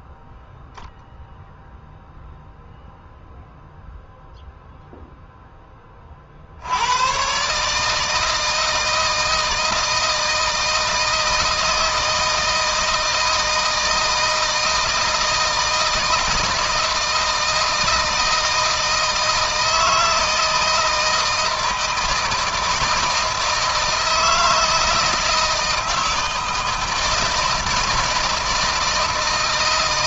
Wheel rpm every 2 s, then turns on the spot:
0, 0, 0, 90, 160, 160, 160, 160, 160, 160, 160, 160, 160, 160, 160.
none